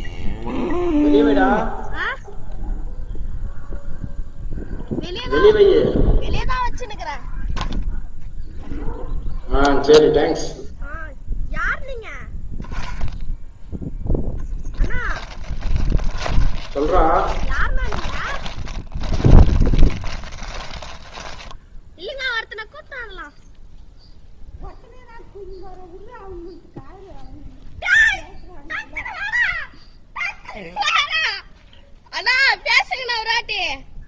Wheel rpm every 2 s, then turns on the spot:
0, 0, 0, 0, 0, 0, 10, 0, 30, 20, 20, 0, 0, 0, 0, 0, 0.
16-22